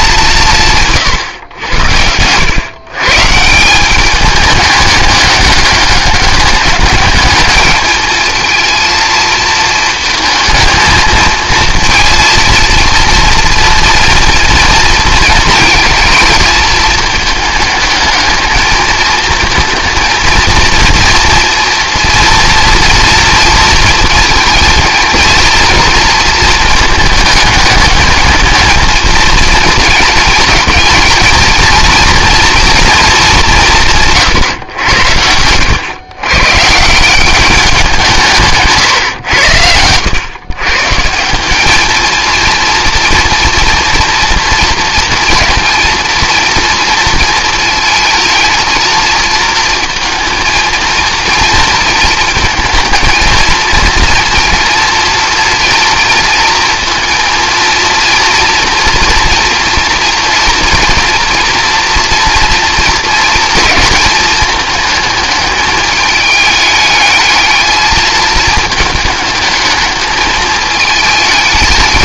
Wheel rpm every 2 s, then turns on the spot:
160, 120, 210, 200, 230, 220, 230, 230, 230, 220, 230, 240, 230, 220, 220, 230, 230, 100, 150, 140, 140, 230, 230, 230, 230, 230, 220, 240, 230, 230, 230, 230, 220, 210, 220, 220.
none